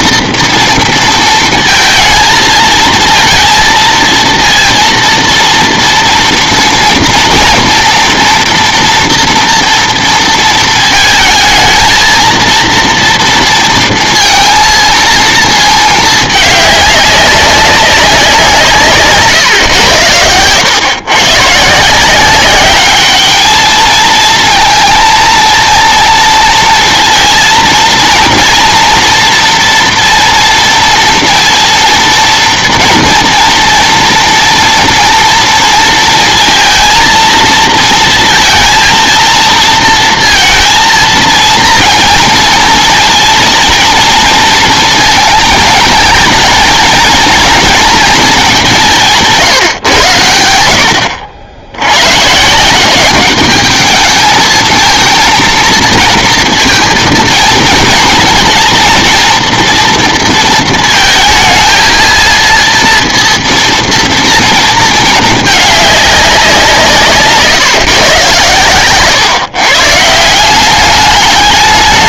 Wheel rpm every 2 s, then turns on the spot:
230, 230, 230, 230, 230, 230, 230, 230, 210, 160, 110, 200, 230, 230, 230, 230, 240, 240, 230, 230, 230, 230, 230, 220, 200, 80, 160, 220, 230, 230, 230, 230, 230, 180, 120, 180.
none